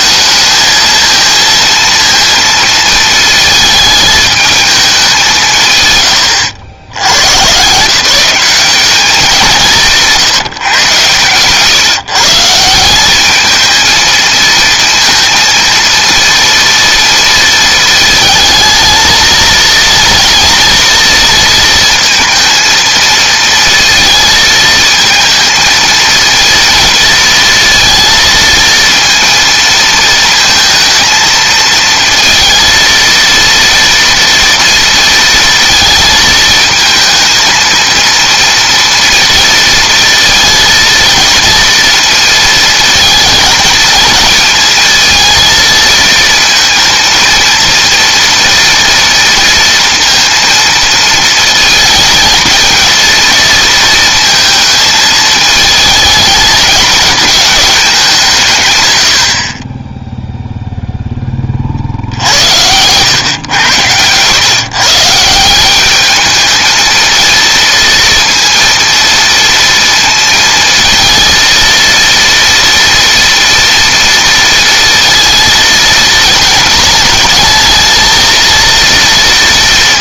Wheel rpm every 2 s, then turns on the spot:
220, 230, 220, 100, 180, 160, 150, 230, 230, 220, 230, 230, 230, 220, 230, 230, 230, 230, 220, 230, 230, 230, 220, 220, 230, 230, 230, 220, 210, 170, 0, 80, 120, 210, 230, 230, 230, 230, 230, 230.
none